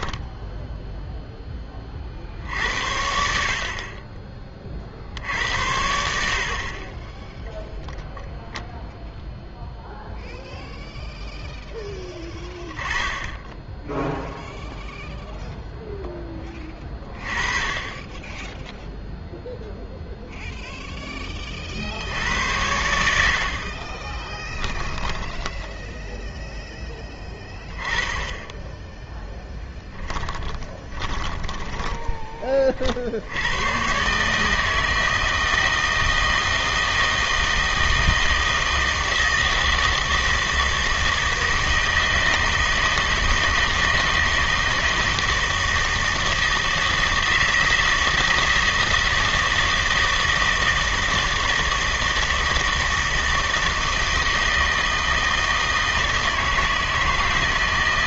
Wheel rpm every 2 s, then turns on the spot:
0, 60, 50, 40, 0, 0, 10, 0, 20, 0, 0, 80, 10, 10, 10, 30, 50, 160, 160, 160, 160, 160, 160, 160, 160, 160, 160, 160, 160.
24-26 30-32